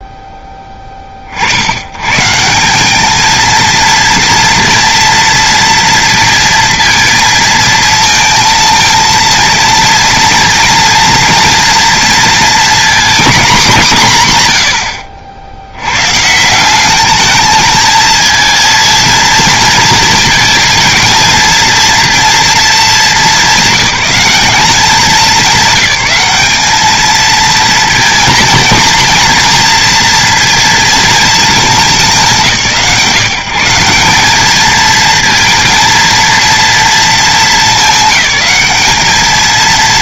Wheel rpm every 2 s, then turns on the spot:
10, 150, 230, 230, 230, 230, 230, 140, 150, 230, 220, 230, 210, 200, 230, 230, 170, 200, 230, 200.
none